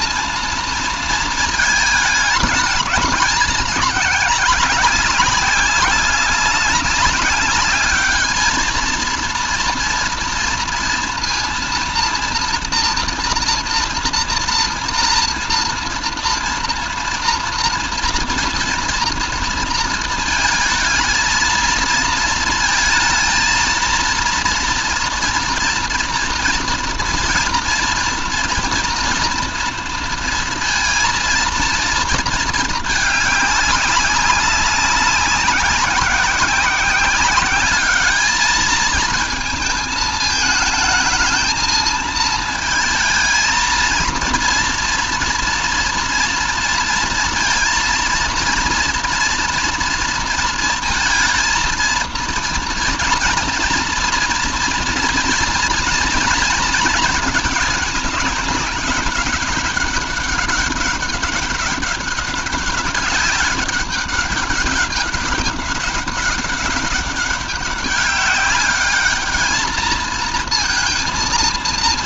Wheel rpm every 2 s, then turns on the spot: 230, 210, 200, 200, 220, 230, 230, 230, 230, 240, 220, 230, 230, 230, 240, 230, 220, 190, 190, 210, 220, 220, 230, 230, 230, 230, 230, 230, 220, 200, 200, 200, 200, 200, 200, 230.
none